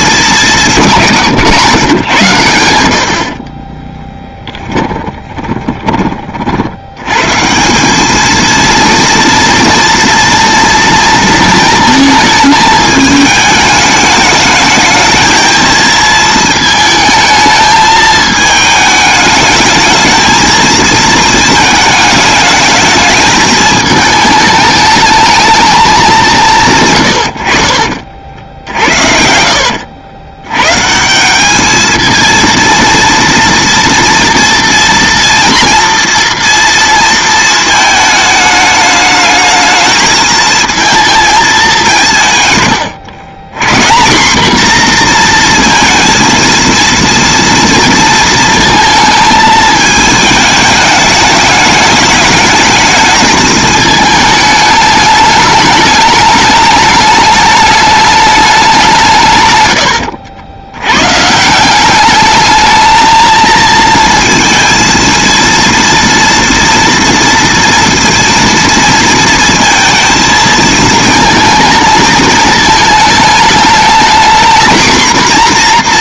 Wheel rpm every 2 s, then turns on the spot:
180, 80, 20, 70, 230, 230, 220, 210, 220, 220, 230, 220, 220, 140, 60, 120, 230, 230, 230, 210, 220, 130, 230, 230, 230, 210, 210, 210, 210, 200, 90, 220, 230, 230, 230, 220, 220, 240.
4-6 28-30